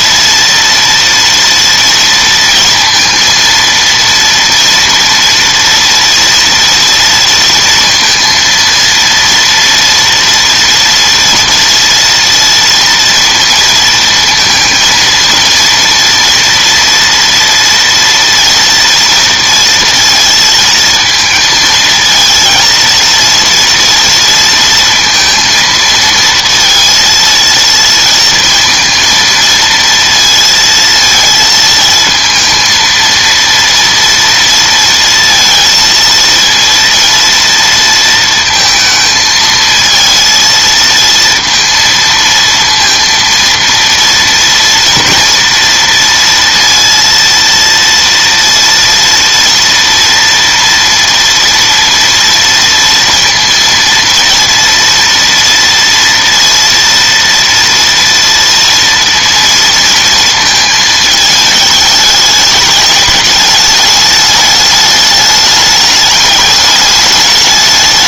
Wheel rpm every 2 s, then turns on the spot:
230, 230, 230, 230, 230, 230, 230, 230, 230, 230, 220, 230, 230, 230, 230, 230, 220, 230, 230, 230, 230, 230, 230, 230, 230, 230, 230, 240, 230, 230, 220, 210, 210, 210.
none